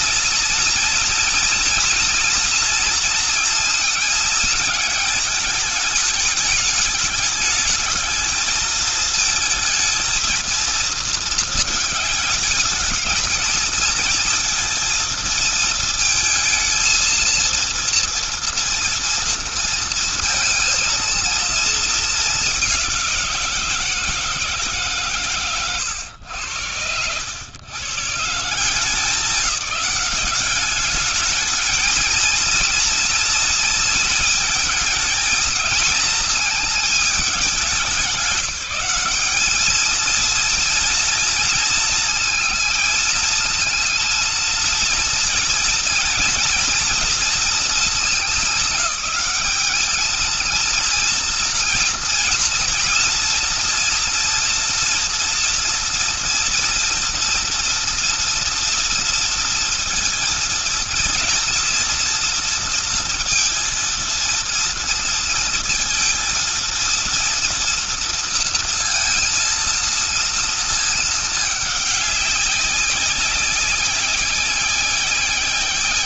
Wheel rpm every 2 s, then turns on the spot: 230, 230, 210, 210, 220, 220, 220, 230, 230, 230, 230, 180, 130, 100, 190, 210, 230, 230, 210, 210, 230, 220, 230, 230, 190, 230, 230, 230, 230, 230, 230, 230, 230, 230, 230, 220, 190, 190.
none